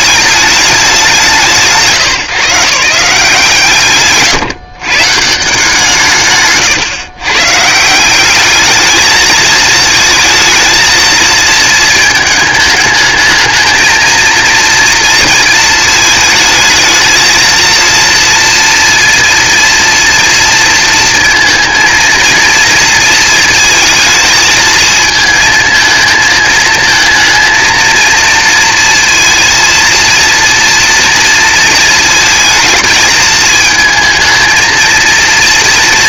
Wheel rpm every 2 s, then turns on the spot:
210, 160, 130, 140, 210, 220, 220, 230, 220, 230, 230, 230, 220, 220, 230, 230, 220, 230.
none